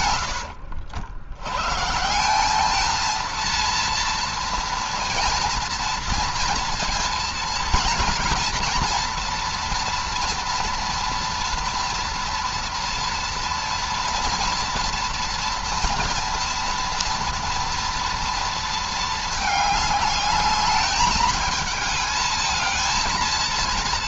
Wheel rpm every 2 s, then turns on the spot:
90, 190, 230, 230, 230, 230, 240, 230, 230, 230, 210, 220.
0-2